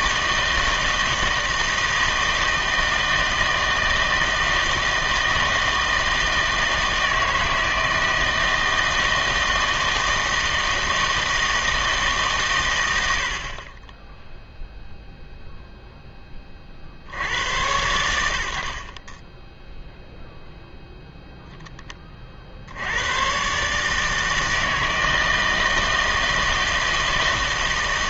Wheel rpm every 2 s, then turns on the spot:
160, 160, 160, 160, 160, 160, 100, 0, 50, 50, 0, 60, 160, 160.
none